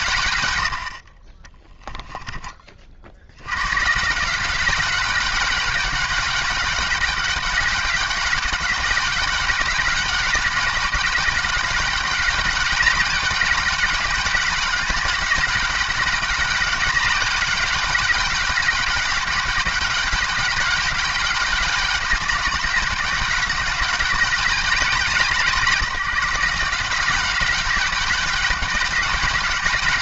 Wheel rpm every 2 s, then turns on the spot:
90, 40, 190, 210, 200, 200, 190, 190, 180, 190, 200, 200, 180, 170, 200.
0-2